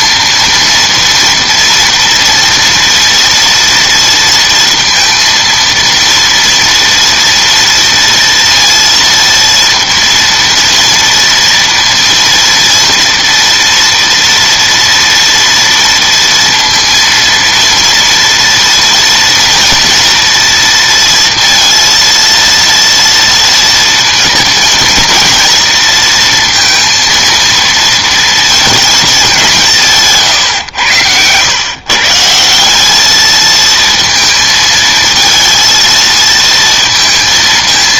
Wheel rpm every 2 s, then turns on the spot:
230, 230, 230, 230, 230, 230, 230, 230, 230, 240, 230, 230, 220, 230, 230, 110, 180, 220, 220.
none